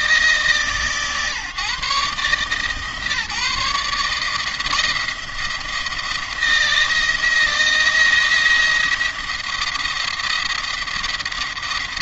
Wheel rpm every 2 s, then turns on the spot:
160, 150, 170, 170, 170, 170.
none